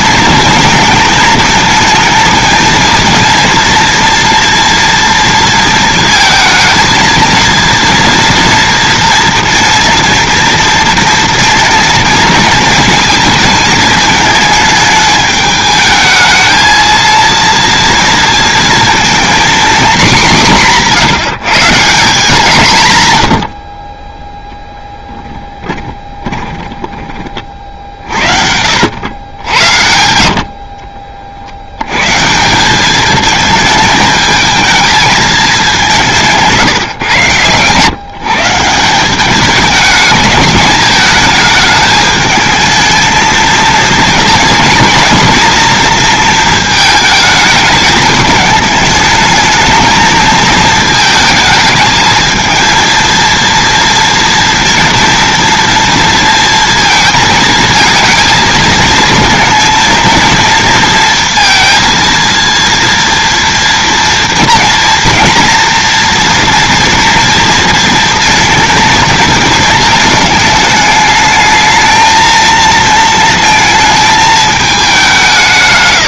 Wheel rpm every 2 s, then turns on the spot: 230, 230, 230, 230, 230, 230, 220, 220, 220, 230, 180, 180, 0, 10, 70, 50, 190, 220, 150, 170, 210, 220, 220, 220, 210, 220, 230, 230, 230, 220, 230, 230, 230, 240, 230, 210, 230, 210.
26-30